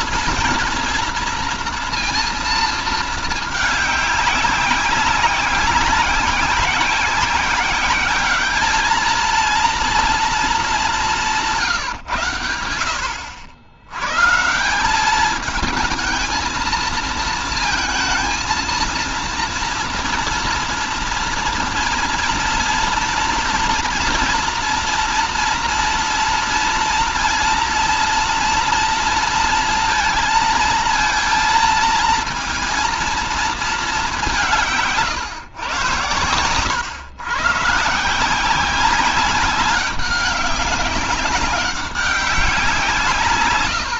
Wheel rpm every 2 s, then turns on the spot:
230, 230, 190, 190, 210, 220, 100, 160, 230, 230, 230, 230, 230, 230, 230, 230, 230, 160, 120, 180, 200, 170.
none